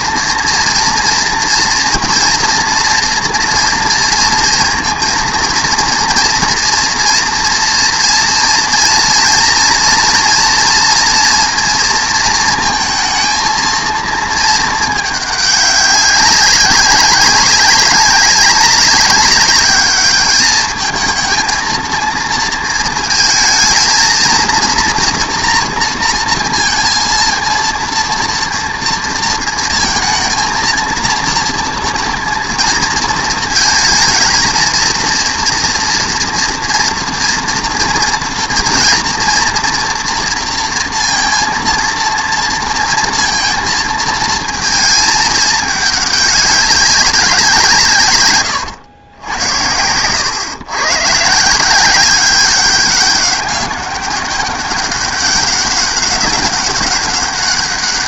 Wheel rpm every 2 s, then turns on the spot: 230, 230, 230, 240, 230, 230, 230, 220, 200, 190, 220, 230, 230, 230, 230, 230, 230, 230, 230, 230, 230, 230, 220, 190, 120, 130, 190, 200, 200.
48-50